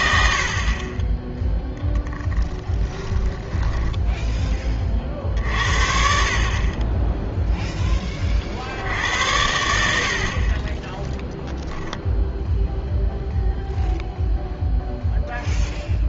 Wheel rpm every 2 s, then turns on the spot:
30, 10, 30, 30, 60, 20, 0, 0.
2-4